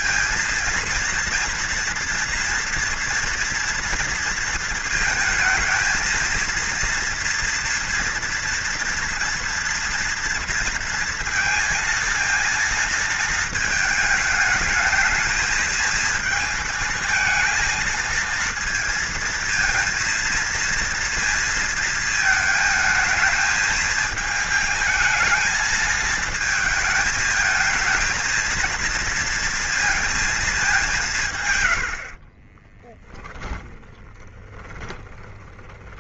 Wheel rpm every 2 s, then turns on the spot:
230, 230, 220, 230, 230, 230, 220, 220, 220, 230, 230, 220, 230, 230, 230, 190, 30, 20.
32-36